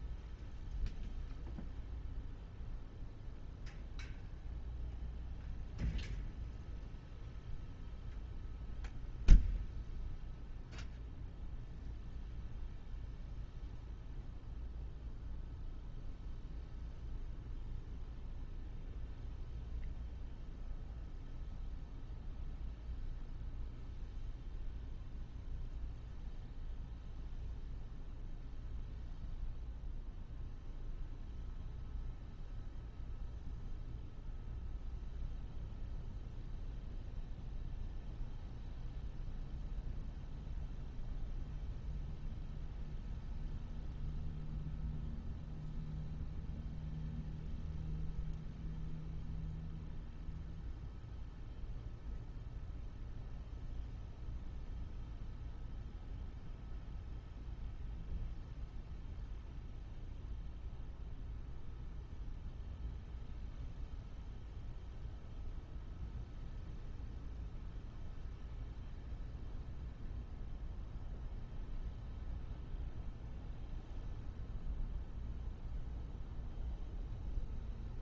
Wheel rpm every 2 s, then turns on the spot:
0, 0, 0, 0, 0, 0, 0, 0, 0, 0, 0, 0, 0, 0, 0, 0, 0, 0, 0, 0, 0, 0, 0, 0, 0, 0, 0, 0, 0, 0, 0, 0, 0, 0, 0, 0, 0, 0, 0.
none